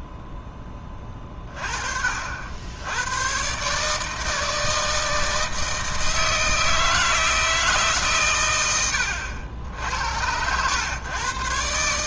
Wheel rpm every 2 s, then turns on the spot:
10, 80, 160, 160, 100, 110.
none